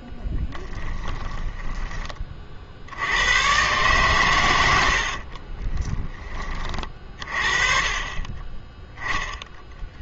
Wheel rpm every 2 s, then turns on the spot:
10, 40, 100, 30, 20.
0-2